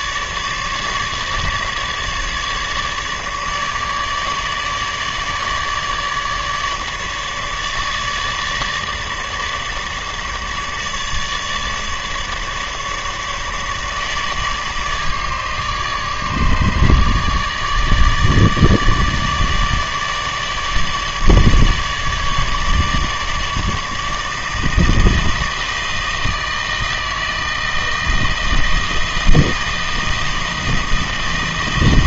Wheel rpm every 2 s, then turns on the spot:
150, 150, 150, 150, 150, 150, 150, 150, 150, 150, 150, 150, 160, 160, 160, 160.
none